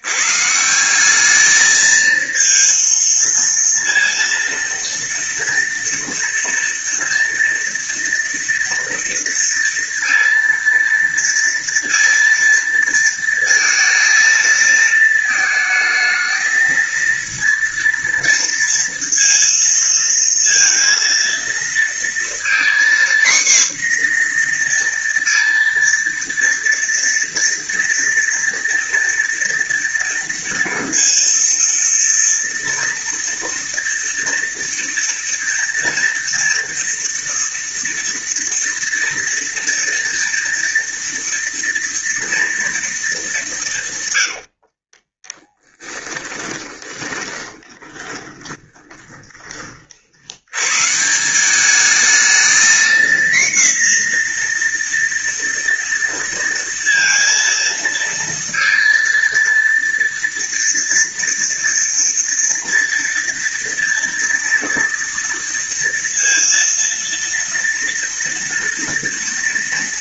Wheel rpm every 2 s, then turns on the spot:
170, 230, 230, 230, 230, 230, 230, 220, 230, 230, 230, 240, 240, 230, 230, 230, 230, 230, 230, 230, 230, 230, 50, 20, 20, 130, 230, 240, 230, 230, 230, 230, 230, 230, 230.
44-50